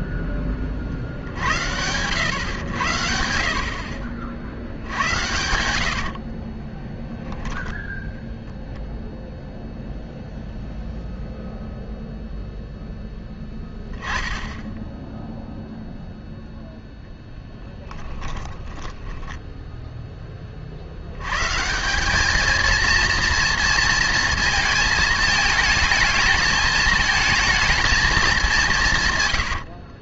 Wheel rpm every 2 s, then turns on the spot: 50, 90, 80, 20, 0, 0, 0, 10, 0, 10, 50, 230, 220, 220, 180.
4-8 14-16 18-20